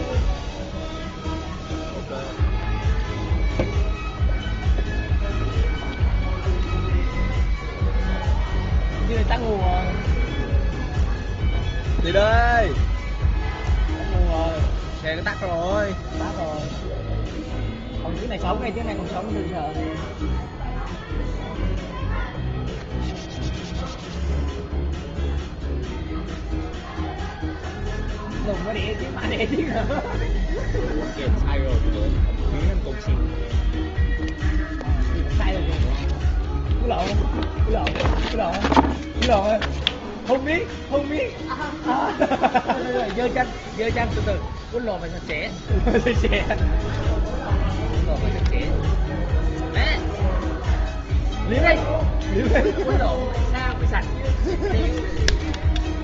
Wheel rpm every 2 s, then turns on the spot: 0, 0, 0, 0, 0, 0, 0, 0, 0, 0, 0, 0, 0, 0, 0, 0, 0, 0, 0, 0, 0, 0, 0, 0, 0, 0, 0, 0.
none